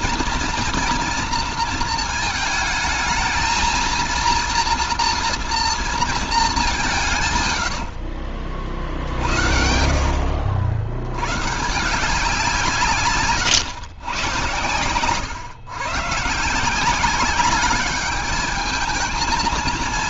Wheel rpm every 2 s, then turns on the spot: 230, 220, 240, 170, 50, 90, 170, 130, 170, 220.
14-16